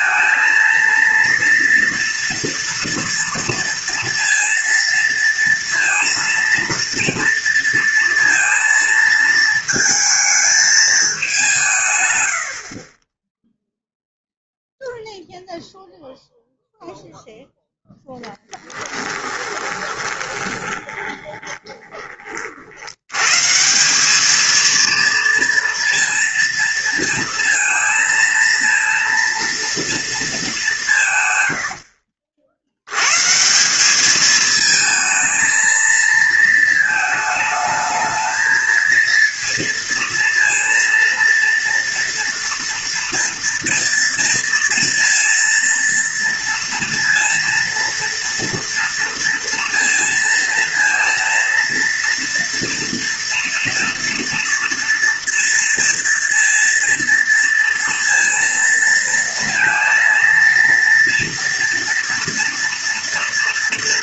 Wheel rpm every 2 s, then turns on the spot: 230, 230, 230, 230, 230, 220, 40, 0, 0, 10, 20, 70, 230, 230, 230, 180, 80, 220, 230, 230, 230, 230, 230, 230, 230, 230, 230, 230, 230, 230, 230, 230.
18-22